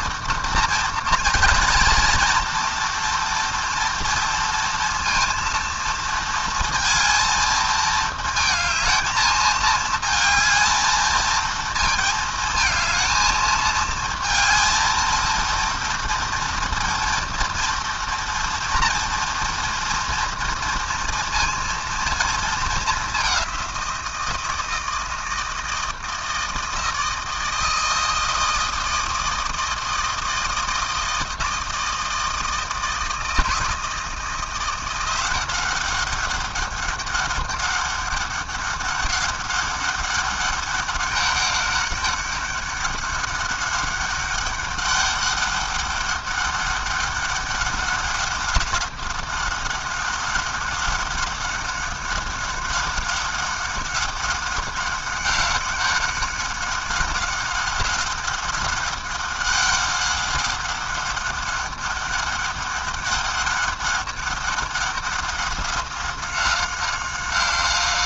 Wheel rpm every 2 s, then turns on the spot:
230, 230, 230, 230, 220, 220, 220, 220, 230, 230, 230, 210, 160, 160, 160, 160, 160, 170, 200, 200, 200, 200, 200, 200, 200, 190, 200, 190, 190, 190, 190, 200, 190, 190.
none